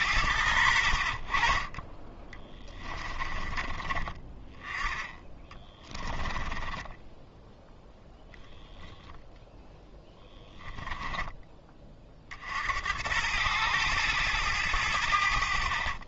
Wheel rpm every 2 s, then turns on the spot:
70, 20, 10, 20, 0, 10, 70, 90.
2-4 6-8